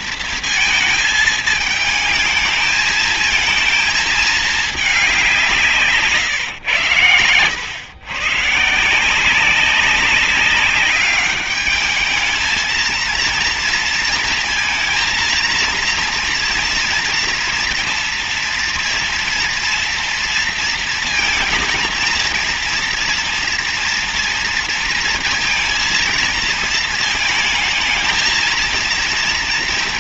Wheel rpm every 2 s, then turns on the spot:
220, 220, 210, 120, 140, 200, 220, 230, 230, 230, 230, 240, 230, 230, 230.
none